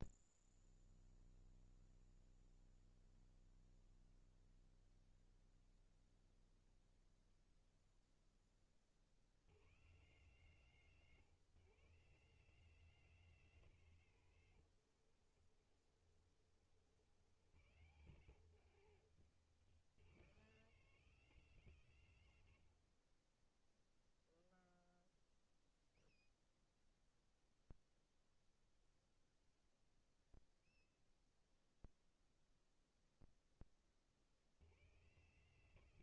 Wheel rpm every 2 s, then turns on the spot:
0, 0, 0, 0, 90, 150, 180, 50, 90, 110, 160, 20, 0, 0, 0, 0, 0, 150.
14-16 18-20